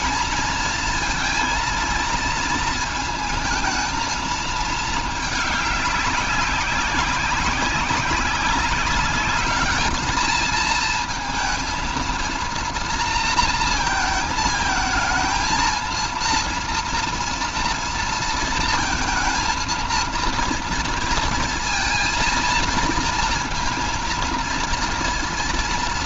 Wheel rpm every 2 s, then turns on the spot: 230, 220, 220, 190, 200, 230, 230, 220, 230, 230, 230, 230, 230.
none